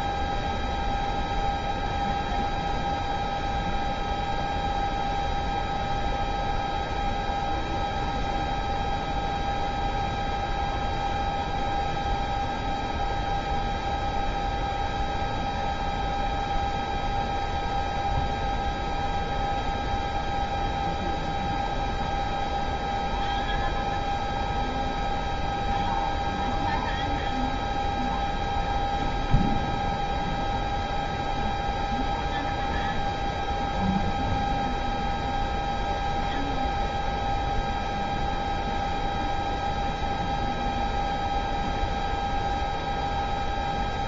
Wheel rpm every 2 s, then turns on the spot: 0, 0, 0, 0, 0, 0, 0, 0, 0, 0, 0, 0, 0, 0, 0, 0, 0, 0, 0, 0, 0, 0.
none